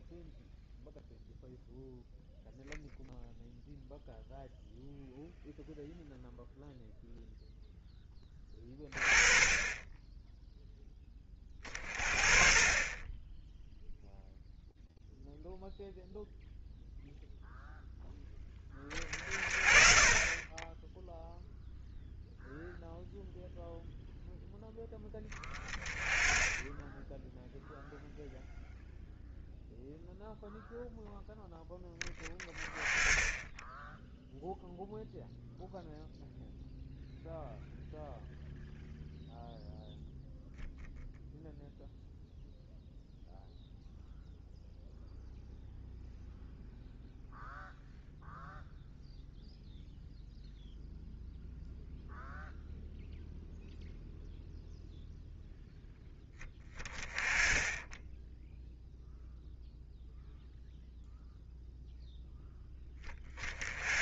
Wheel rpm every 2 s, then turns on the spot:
0, 0, 0, 0, 20, 0, 30, 0, 0, 20, 10, 0, 10, 10, 0, 0, 20, 0, 0, 0, 0, 0, 0, 0, 0, 0, 0, 0, 20, 0, 0, 10.
none